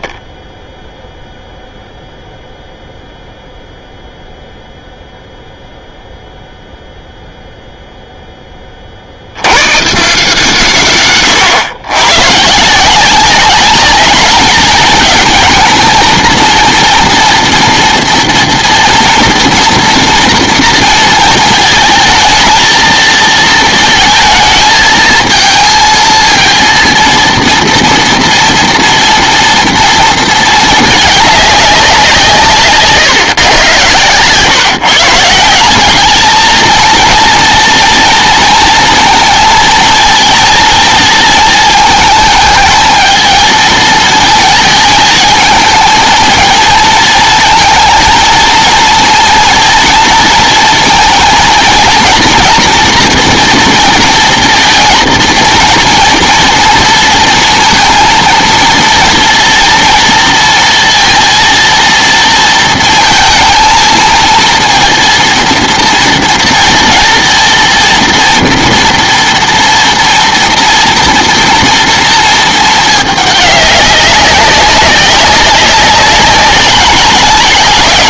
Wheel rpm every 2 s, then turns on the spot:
0, 0, 0, 0, 40, 140, 170, 220, 230, 230, 230, 230, 220, 230, 230, 210, 150, 150, 230, 230, 230, 220, 220, 230, 230, 230, 240, 230, 230, 230, 230, 230, 230, 230, 230, 230, 210, 190, 190.
none